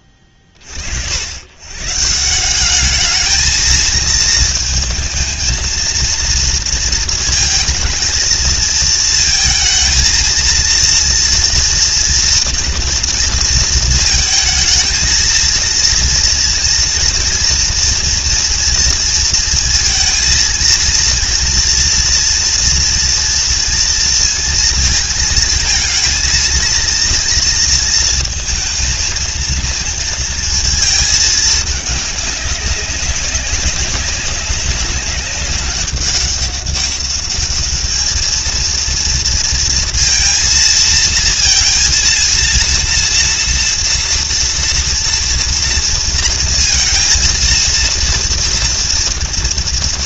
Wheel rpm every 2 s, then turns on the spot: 50, 200, 220, 230, 230, 230, 240, 220, 230, 230, 230, 230, 220, 230, 230, 220, 200, 200, 200, 230, 230, 230, 230, 230, 230.
none